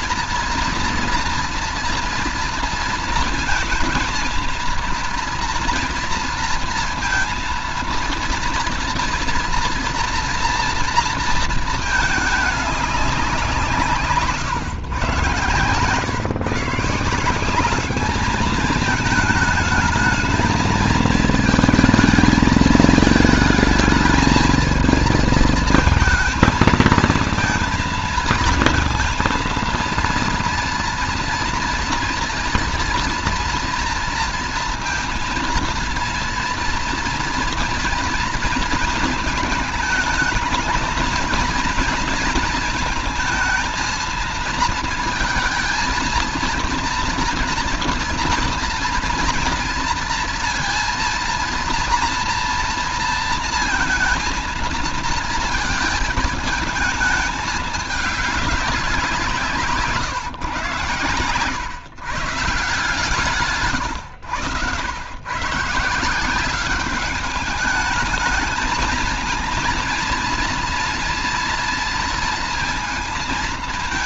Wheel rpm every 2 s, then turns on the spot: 230, 230, 230, 230, 230, 230, 210, 140, 150, 210, 220, 220, 220, 220, 230, 230, 230, 230, 230, 230, 220, 230, 230, 230, 230, 230, 230, 230, 220, 200, 140, 160, 100, 190, 220, 230, 230.
none